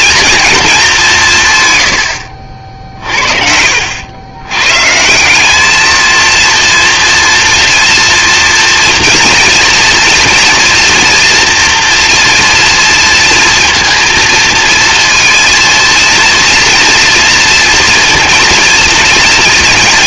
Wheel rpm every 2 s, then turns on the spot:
220, 60, 130, 230, 240, 240, 230, 230, 230, 230.
none